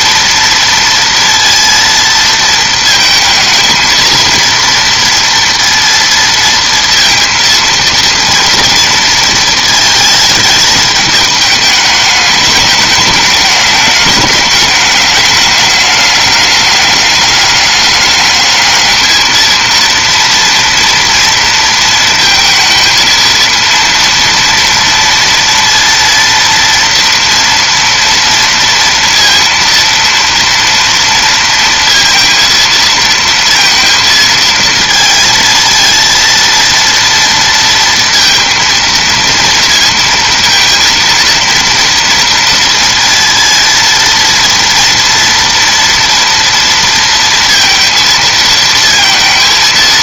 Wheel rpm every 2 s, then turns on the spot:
230, 220, 230, 230, 230, 220, 210, 210, 210, 220, 230, 230, 240, 230, 230, 230, 230, 230, 230, 230, 230, 230, 230, 230, 220.
none